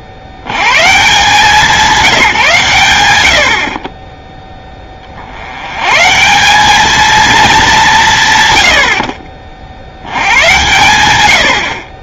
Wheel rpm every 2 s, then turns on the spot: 70, 130, 10, 200, 50, 100.
none